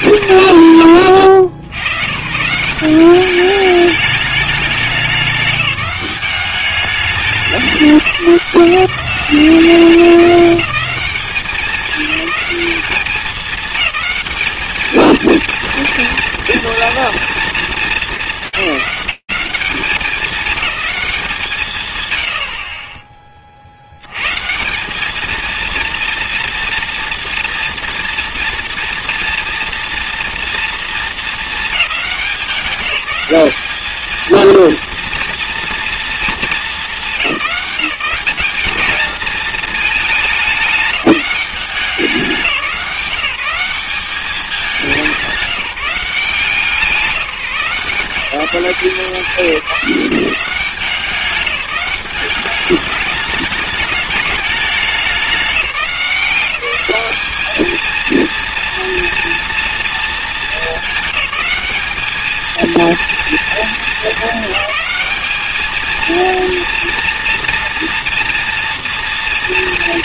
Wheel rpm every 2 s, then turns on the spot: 130, 170, 200, 200, 170, 200, 210, 210, 230, 210, 200, 110, 130, 240, 230, 230, 190, 230, 220, 210, 210, 170, 200, 180, 170, 180, 200, 200, 190, 230, 220, 230, 220, 230, 230.
none